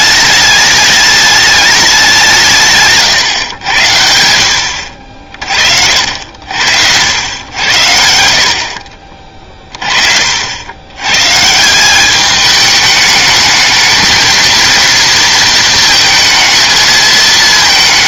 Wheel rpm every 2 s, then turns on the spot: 210, 150, 80, 80, 50, 90, 210, 230, 220.
8-10